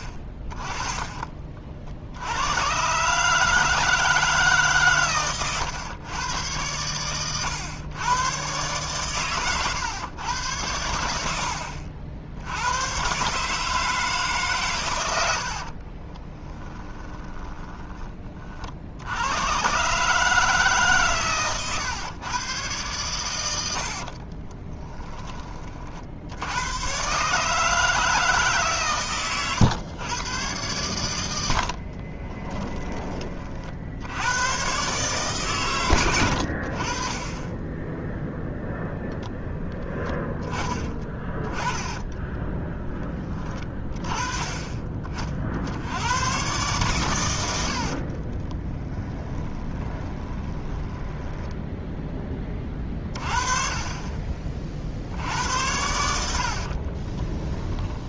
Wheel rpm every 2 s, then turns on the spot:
20, 120, 140, 110, 130, 90, 100, 130, 10, 60, 140, 110, 20, 90, 150, 110, 20, 130, 60, 0, 20, 10, 30, 130, 20, 20, 20, 50, 60.
16-18 24-26 48-52 56-58